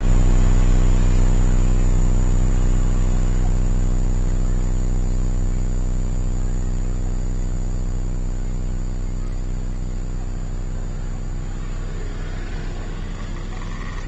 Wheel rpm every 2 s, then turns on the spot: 0, 0, 0, 0, 0, 0, 10.
12-14